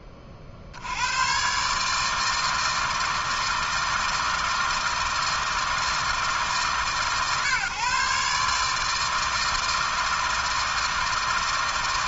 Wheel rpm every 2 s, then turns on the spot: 60, 160, 160, 130, 160, 160.
none